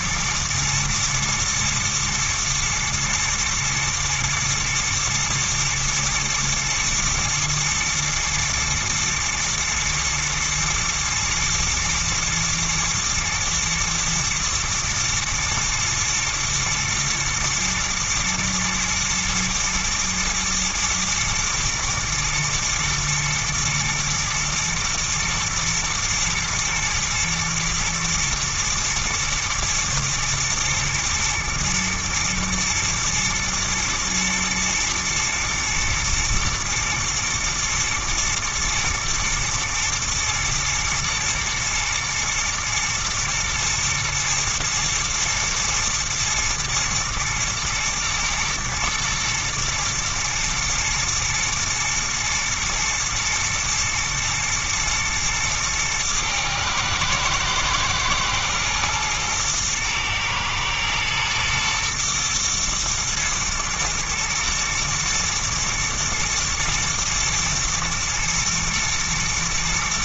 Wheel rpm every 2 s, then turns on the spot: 110, 120, 110, 110, 120, 120, 110, 120, 110, 110, 120, 110, 110, 120, 120, 110, 120, 110, 120, 110, 110, 120, 110, 110, 110, 110, 120, 110, 110, 110, 110, 120, 110, 110, 110.
none